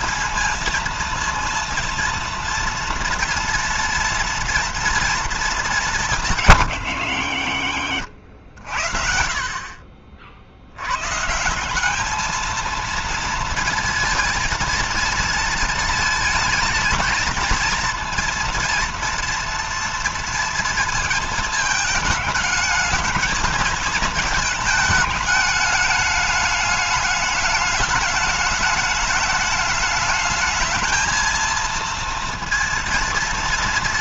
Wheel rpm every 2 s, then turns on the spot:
230, 230, 230, 110, 50, 140, 230, 220, 230, 230, 220, 220, 210, 210, 210, 220, 230.
none